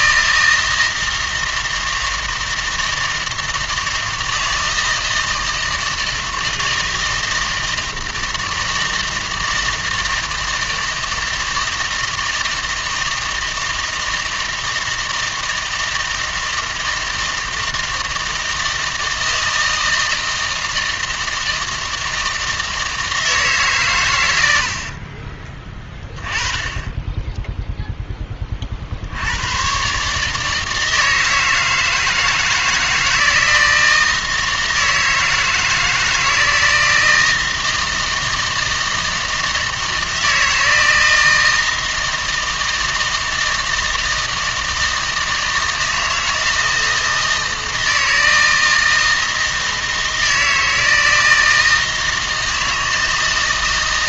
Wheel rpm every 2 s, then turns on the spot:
160, 160, 160, 160, 160, 160, 160, 160, 160, 160, 160, 160, 70, 10, 50, 160, 160, 160, 160, 160, 160, 160, 160, 160, 160, 160, 160.
24-26